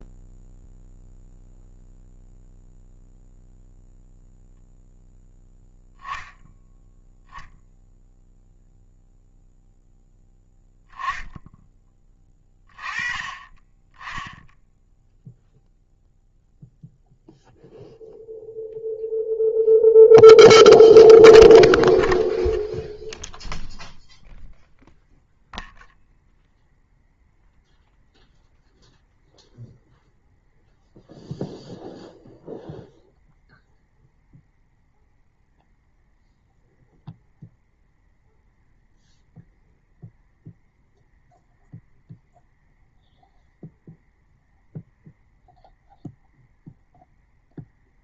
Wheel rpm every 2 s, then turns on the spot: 0, 0, 0, 0, 0, 10, 20, 0, 0, 0, 0, 0, 0, 0, 0, 0, 0, 0, 0, 0, 0, 0, 0, 0.
none